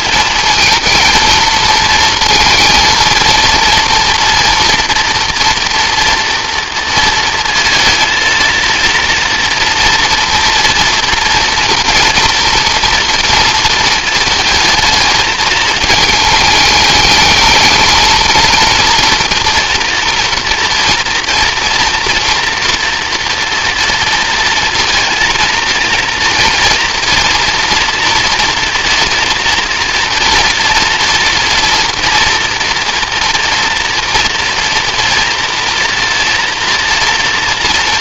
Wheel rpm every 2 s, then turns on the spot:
220, 230, 230, 230, 230, 230, 230, 220, 210, 230, 230, 230, 230, 230, 240, 230, 230, 230, 230.
none